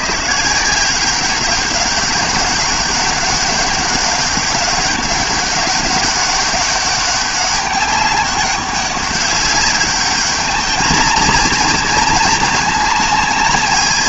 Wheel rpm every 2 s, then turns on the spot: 160, 200, 200, 200, 200, 220, 220.
none